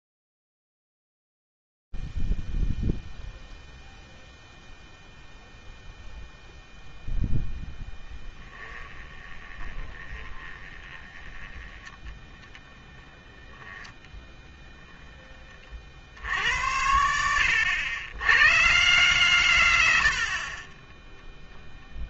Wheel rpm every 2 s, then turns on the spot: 0, 0, 0, 0, 10, 20, 10, 10, 110, 150, 0.
8-16